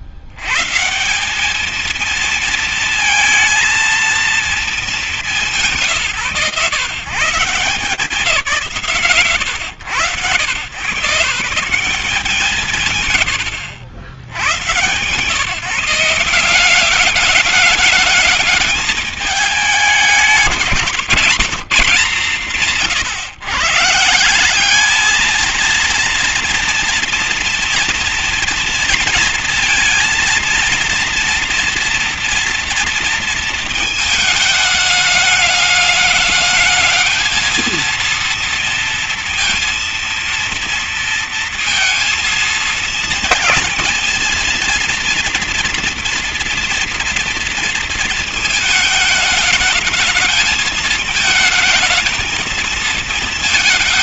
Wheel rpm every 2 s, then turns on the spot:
150, 220, 220, 140, 130, 130, 140, 150, 190, 210, 180, 140, 220, 230, 240, 240, 220, 210, 220, 230, 230, 230, 230, 230, 220, 220, 220.
none